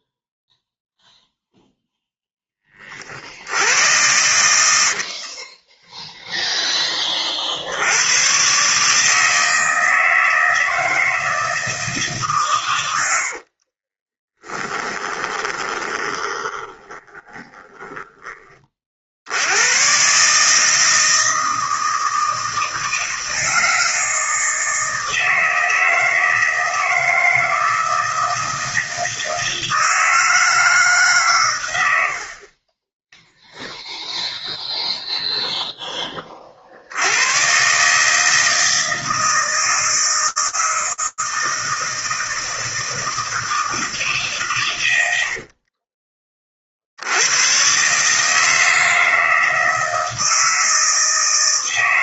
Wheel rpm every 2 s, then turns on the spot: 0, 30, 70, 10, 140, 160, 110, 20, 20, 40, 160, 160, 160, 160, 160, 160, 30, 0, 60, 160, 160, 160, 90, 70, 160, 160.
14-18 44-46